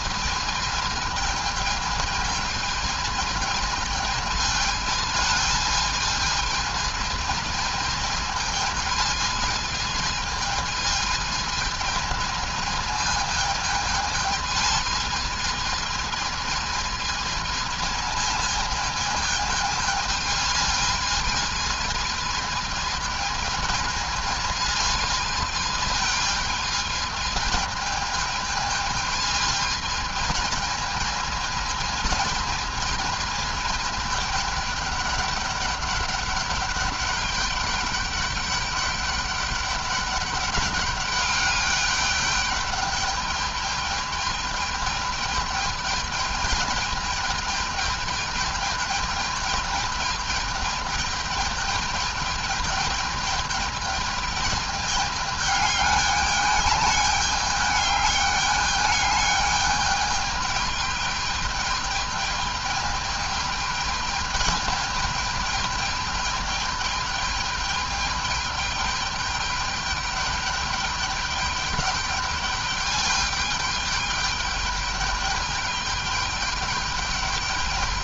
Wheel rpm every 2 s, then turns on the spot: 220, 220, 220, 220, 220, 220, 220, 220, 220, 220, 220, 220, 220, 220, 220, 220, 220, 210, 210, 200, 200, 210, 210, 210, 210, 210, 210, 210, 210, 210, 210, 210, 210, 210, 210, 210, 210, 210, 210.
none